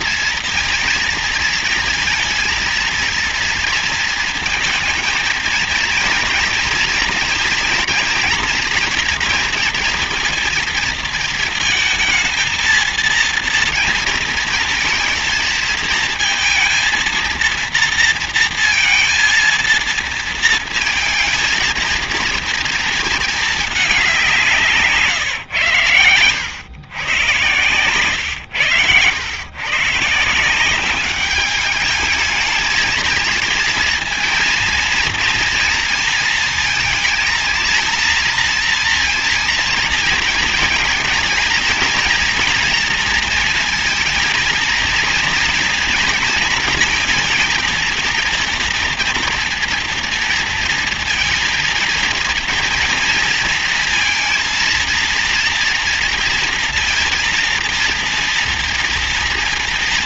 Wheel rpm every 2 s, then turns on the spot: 230, 230, 230, 240, 240, 230, 220, 230, 230, 230, 230, 230, 160, 120, 110, 180, 220, 230, 230, 230, 230, 240, 230, 230, 230, 230, 230, 230, 230, 230.
none